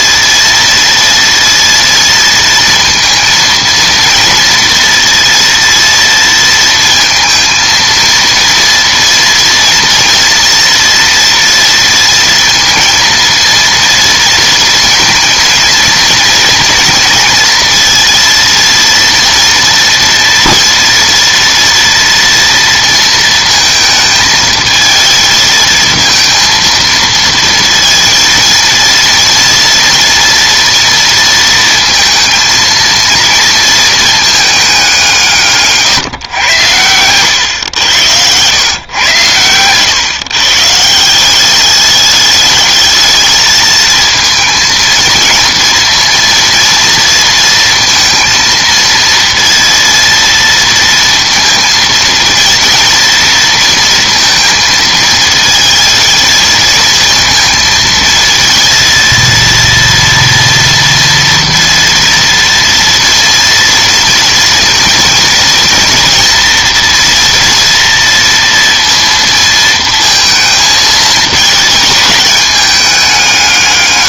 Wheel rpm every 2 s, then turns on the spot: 230, 230, 230, 230, 230, 230, 230, 230, 230, 230, 230, 230, 220, 230, 230, 230, 230, 190, 110, 110, 170, 220, 230, 230, 230, 230, 230, 220, 230, 230, 230, 230, 230, 230, 230, 220, 190.
36-38